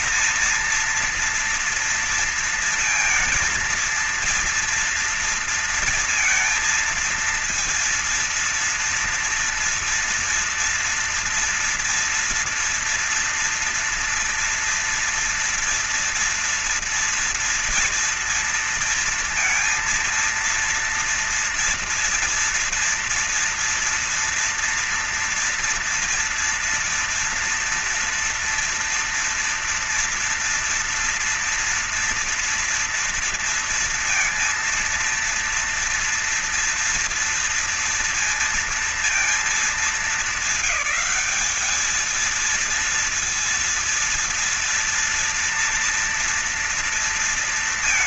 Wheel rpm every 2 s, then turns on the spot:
230, 230, 230, 230, 230, 230, 240, 230, 230, 230, 230, 230, 230, 230, 230, 230, 230, 230, 230, 230, 190, 230, 230, 230.
none